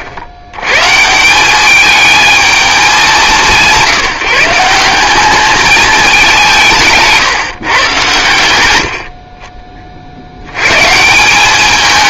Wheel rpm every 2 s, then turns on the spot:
120, 220, 170, 160, 90, 120.
none